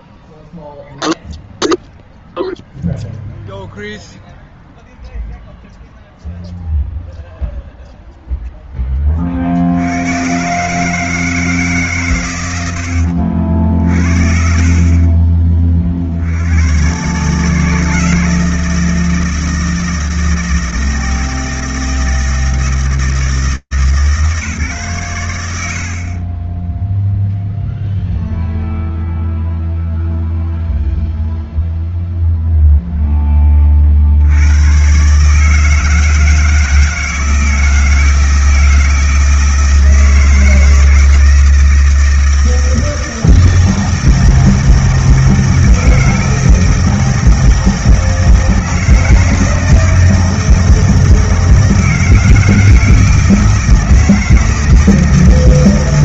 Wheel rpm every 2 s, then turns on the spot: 0, 0, 0, 0, 0, 130, 100, 50, 110, 160, 160, 160, 120, 0, 0, 0, 10, 140, 160, 160, 160, 160, 160, 160, 160, 160, 160, 160.
none